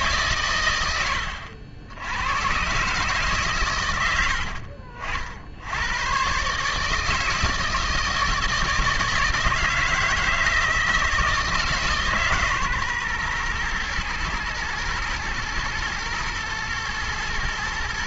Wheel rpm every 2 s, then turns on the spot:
130, 110, 70, 140, 160, 160, 140, 120, 110.
none